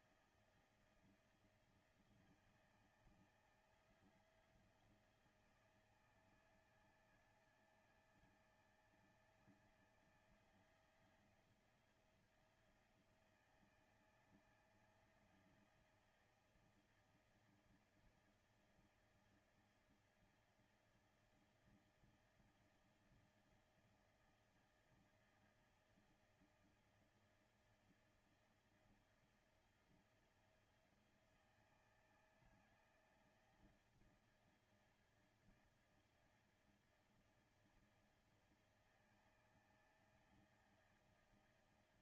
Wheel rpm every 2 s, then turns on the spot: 160, 160, 170, 160, 160, 170, 170, 160, 160, 160, 160, 160, 160, 160, 160, 160, 160, 160, 160, 160, 160.
none